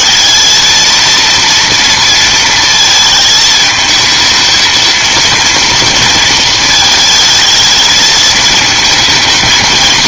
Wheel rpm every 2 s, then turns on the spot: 230, 220, 230, 220, 220.
none